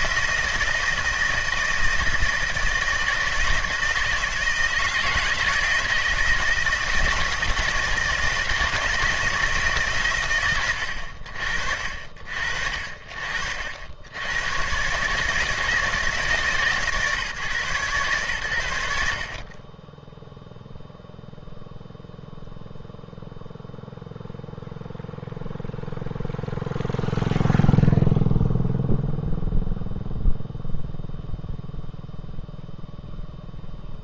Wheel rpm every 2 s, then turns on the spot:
160, 160, 160, 160, 160, 70, 50, 130, 150, 70, 0, 0, 0, 0, 0, 0, 0.
none